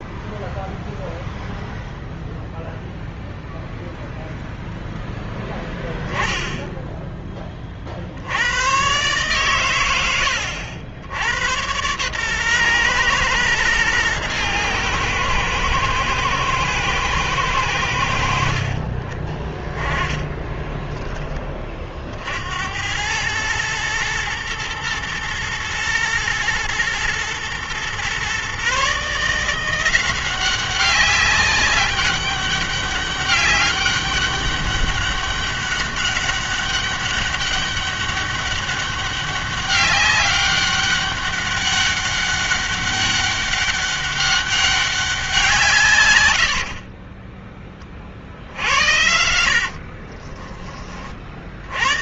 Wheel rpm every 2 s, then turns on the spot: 0, 0, 0, 10, 110, 80, 120, 110, 110, 40, 10, 80, 110, 110, 140, 190, 200, 200, 200, 200, 200, 200, 200, 70, 60, 30.
46-50